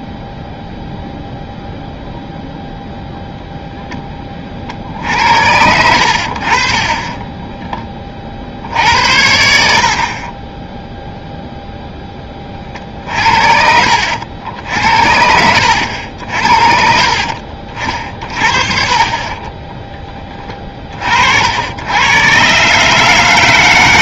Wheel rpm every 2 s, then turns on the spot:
0, 0, 50, 30, 50, 0, 40, 80, 50, 50, 30, 130.
6-8